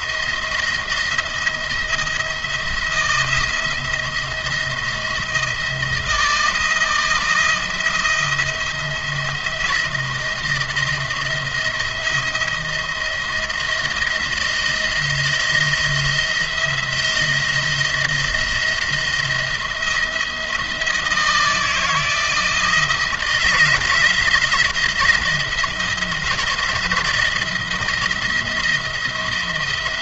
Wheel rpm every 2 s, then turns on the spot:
170, 170, 160, 160, 170, 170, 170, 160, 160, 170, 170, 160, 170, 160, 170.
none